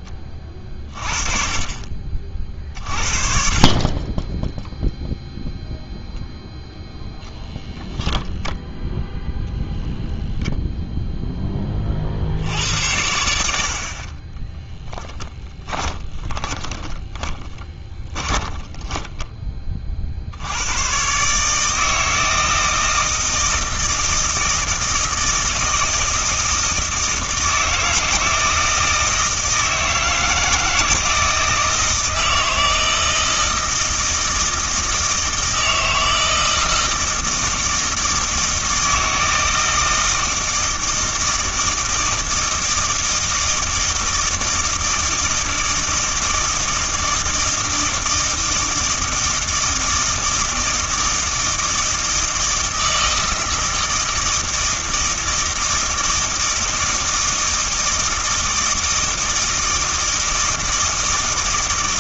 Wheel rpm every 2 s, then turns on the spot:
30, 40, 0, 0, 0, 0, 90, 10, 20, 10, 110, 160, 160, 160, 160, 160, 160, 160, 160, 160, 160, 160, 160, 160, 160, 160, 160, 160, 160, 160, 160.
14-20